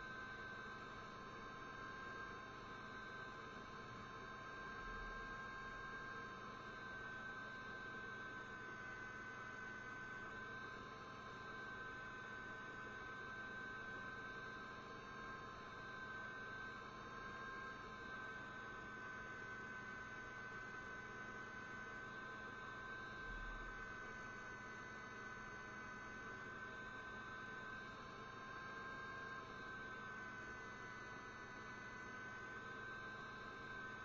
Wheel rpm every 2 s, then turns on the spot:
0, 0, 0, 0, 0, 0, 0, 0, 0, 0, 0, 0, 0, 0, 0, 0, 0.
none